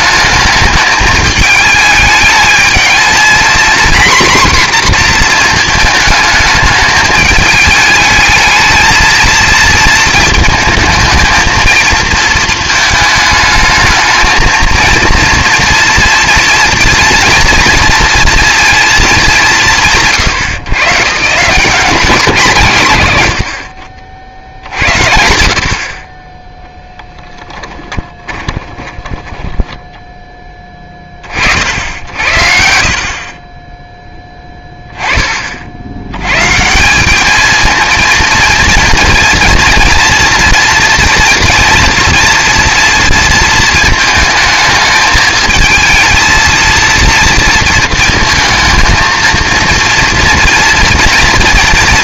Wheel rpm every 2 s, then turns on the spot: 220, 220, 250, 210, 220, 220, 220, 230, 230, 230, 130, 150, 80, 10, 20, 20, 60, 10, 150, 230, 230, 230, 220, 230, 220, 230.
26-30